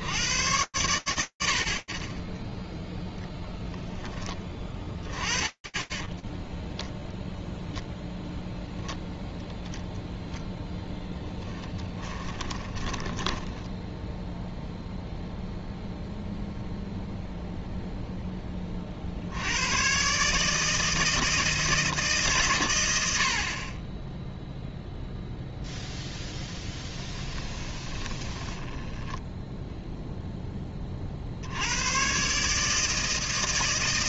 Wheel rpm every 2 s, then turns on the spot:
50, 10, 0, 0, 0, 20, 0, 0, 0, 130, 150, 10, 0, 10, 0, 80, 140.
10-12 26-28